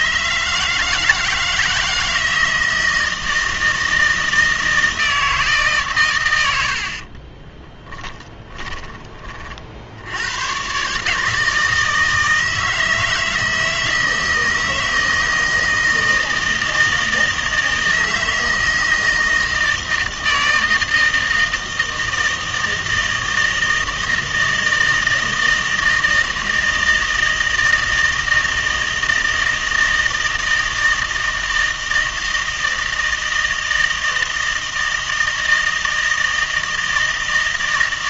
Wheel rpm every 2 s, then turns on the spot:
150, 160, 160, 80, 20, 130, 160, 160, 160, 160, 160, 160, 160, 160, 160, 160, 160, 160, 160.
none